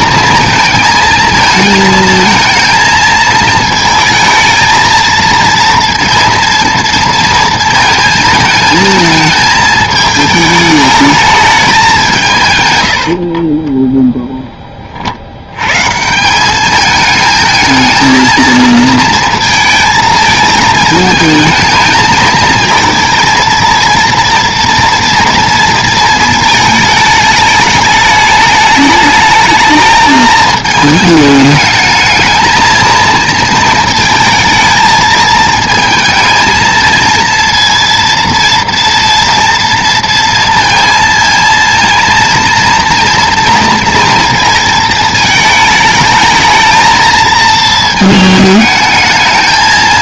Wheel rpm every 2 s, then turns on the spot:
230, 220, 220, 230, 220, 210, 130, 20, 200, 230, 220, 220, 230, 220, 210, 220, 220, 220, 220, 230, 230, 230, 230, 220, 220.
none